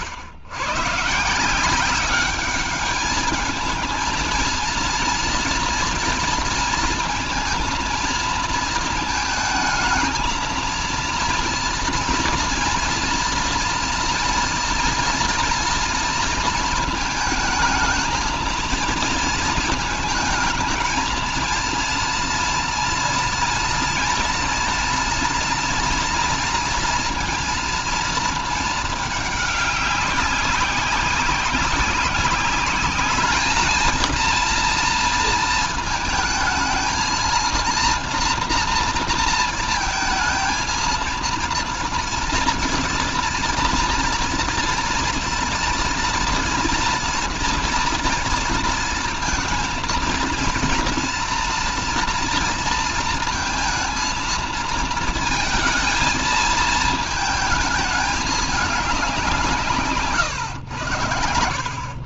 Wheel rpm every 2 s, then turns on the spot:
110, 210, 230, 230, 220, 230, 230, 230, 220, 230, 220, 230, 230, 230, 220, 190, 210, 230, 220, 230, 230, 230, 230, 230, 230, 230, 230, 230, 220, 200, 110.
none